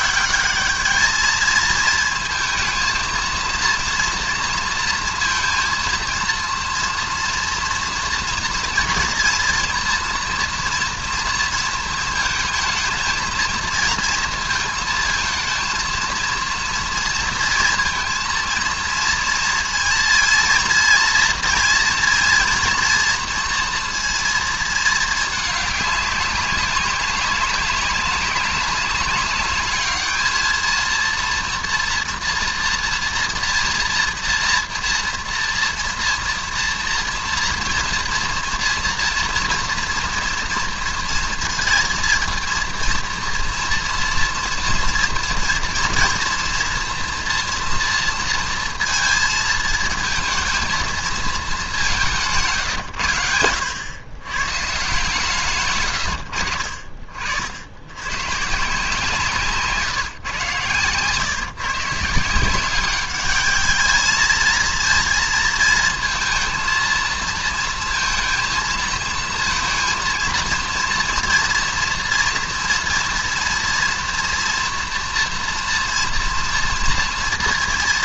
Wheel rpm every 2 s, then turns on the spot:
200, 230, 230, 230, 230, 230, 220, 230, 230, 230, 230, 230, 230, 200, 190, 220, 230, 240, 230, 230, 230, 230, 230, 230, 230, 230, 150, 140, 70, 140, 130, 180, 220, 230, 230, 230, 230, 230, 230.
none